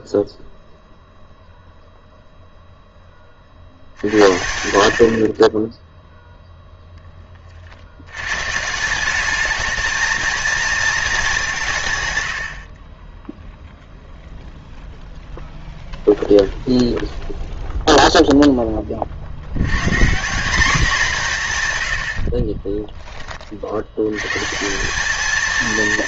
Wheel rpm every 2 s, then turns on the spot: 0, 0, 80, 0, 150, 220, 40, 0, 0, 20, 200, 30, 170.
22-24